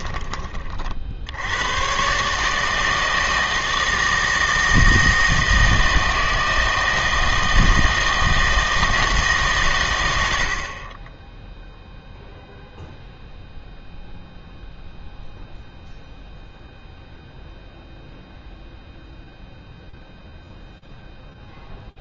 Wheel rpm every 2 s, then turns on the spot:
40, 160, 160, 160, 160, 40, 0, 0, 0, 0, 0.
none